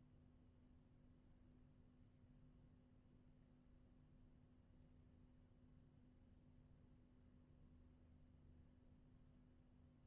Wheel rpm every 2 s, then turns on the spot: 0, 0, 0, 0, 0.
none